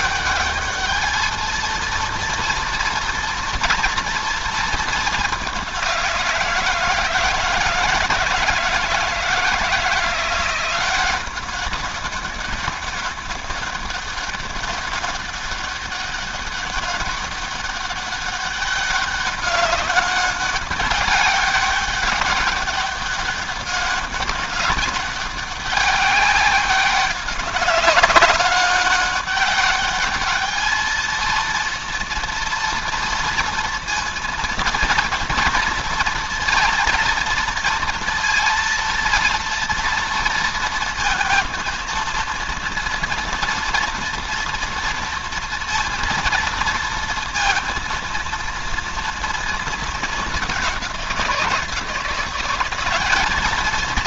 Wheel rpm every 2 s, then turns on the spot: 210, 230, 220, 160, 160, 180, 200, 200, 200, 200, 200, 200, 200, 200, 200, 220, 230, 230, 230, 230, 230, 230, 230, 230, 230, 190, 190.
none